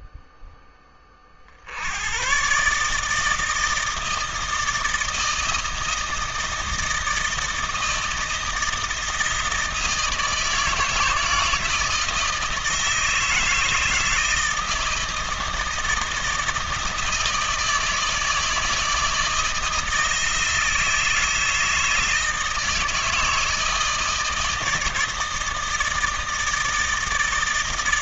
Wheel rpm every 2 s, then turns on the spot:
10, 120, 160, 160, 160, 160, 160, 160, 170, 160, 160, 160, 160, 160.
none